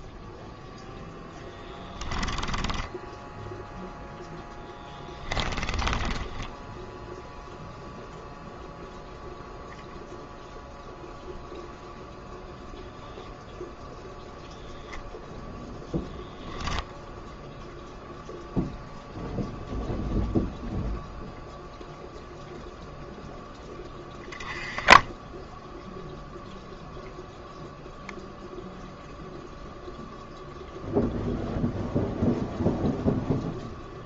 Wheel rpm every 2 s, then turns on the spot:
0, 0, 10, 0, 0, 0, 0, 0, 0, 0, 0, 0, 10, 0, 0, 0, 0.
4-6